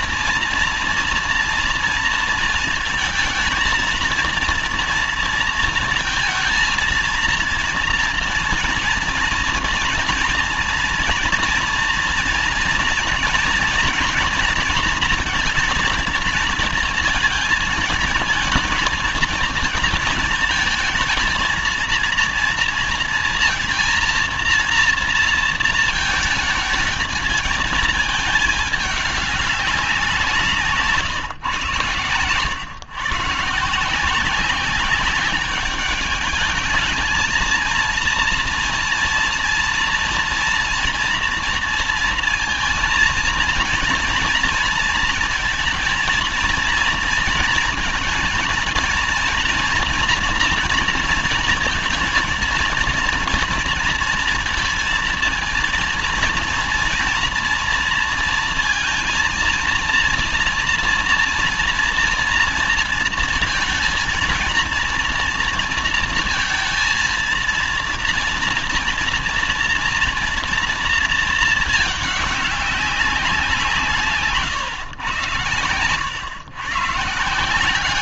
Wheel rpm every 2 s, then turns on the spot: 240, 230, 230, 230, 230, 230, 230, 230, 220, 220, 220, 230, 230, 220, 210, 150, 130, 190, 210, 230, 230, 230, 230, 230, 230, 230, 230, 230, 230, 230, 240, 230, 230, 230, 230, 230, 200, 130, 130.
none